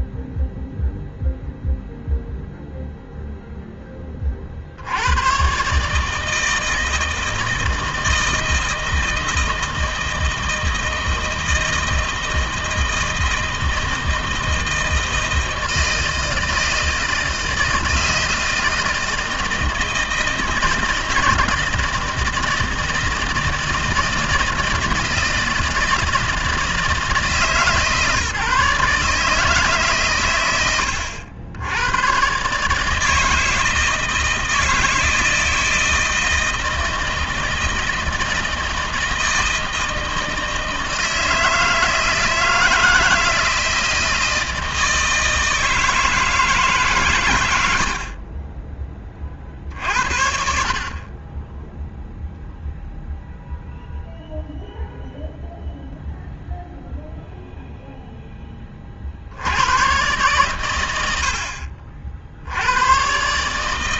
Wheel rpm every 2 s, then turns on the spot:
0, 0, 60, 160, 160, 160, 160, 160, 160, 160, 160, 160, 160, 160, 140, 100, 150, 160, 160, 160, 160, 160, 160, 150, 30, 50, 0, 0, 0, 30, 100, 90.
48-50